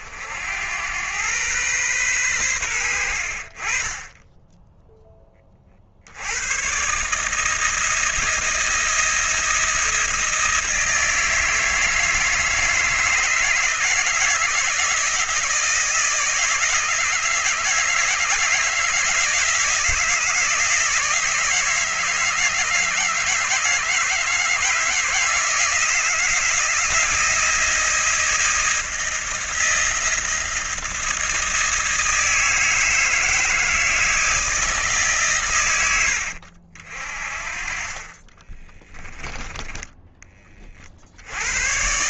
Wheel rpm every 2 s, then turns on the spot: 100, 90, 10, 140, 160, 160, 160, 160, 160, 160, 160, 160, 160, 170, 170, 170, 160, 160, 60, 10, 40.
38-40